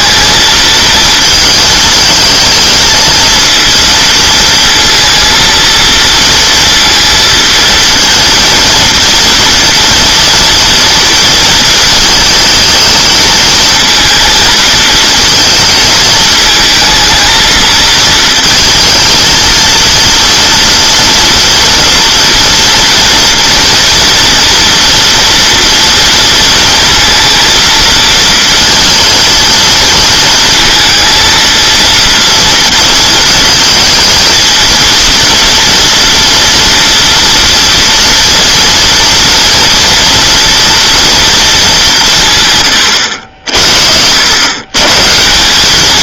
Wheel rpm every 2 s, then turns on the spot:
230, 220, 230, 230, 230, 230, 220, 220, 230, 230, 230, 230, 230, 230, 230, 230, 220, 230, 230, 230, 230, 120, 140.
none